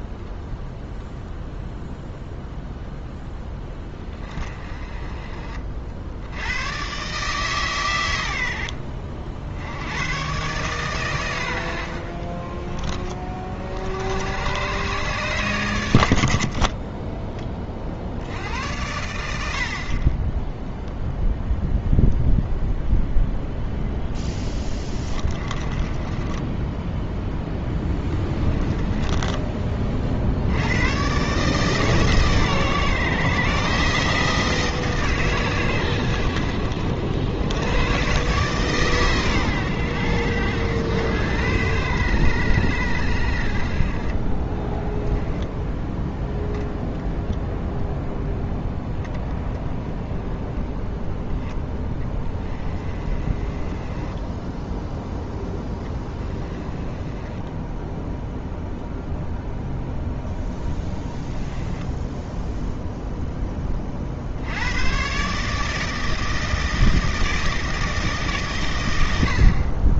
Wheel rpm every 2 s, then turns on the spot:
0, 0, 30, 100, 80, 130, 20, 110, 30, 90, 0, 0, 20, 10, 20, 100, 130, 150, 70, 120, 90, 80, 10, 0, 10, 10, 20, 10, 20, 0, 10, 0, 100, 160, 100.
16-18 24-26 28-30 44-46 52-54 56-58 60-62